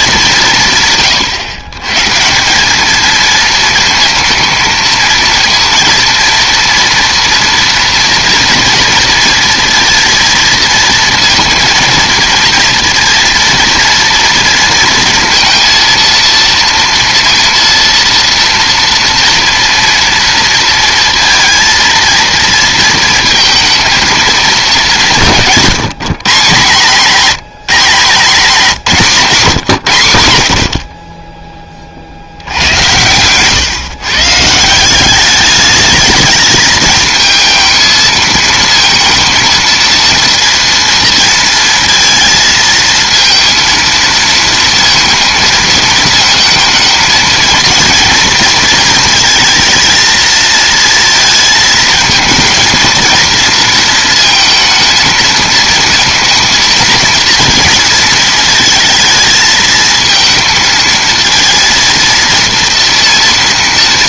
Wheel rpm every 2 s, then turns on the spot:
150, 200, 230, 230, 230, 230, 230, 230, 230, 230, 230, 230, 210, 170, 190, 60, 80, 160, 220, 220, 230, 220, 230, 230, 230, 230, 230, 230, 230, 220, 230, 230.
none